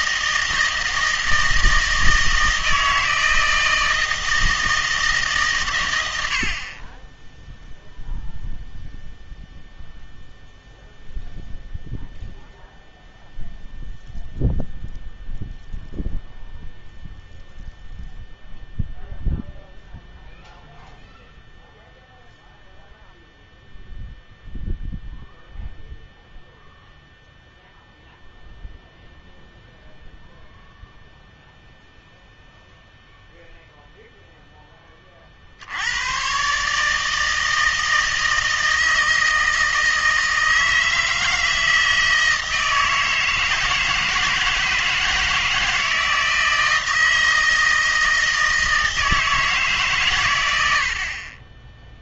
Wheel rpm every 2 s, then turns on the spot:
160, 160, 160, 60, 0, 0, 0, 0, 0, 0, 0, 0, 0, 0, 0, 0, 0, 10, 140, 160, 160, 160, 160, 160, 160, 90.
none